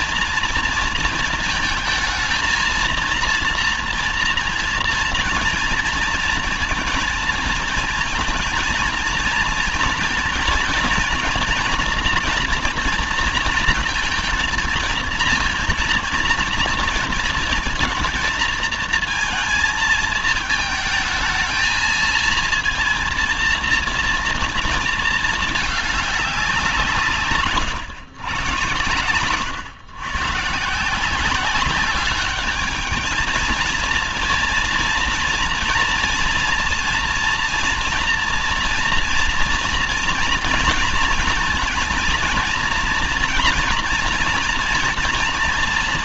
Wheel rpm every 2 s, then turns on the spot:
230, 230, 230, 230, 230, 240, 240, 230, 230, 220, 220, 230, 220, 170, 100, 160, 210, 230, 230, 230, 220, 230, 230.
none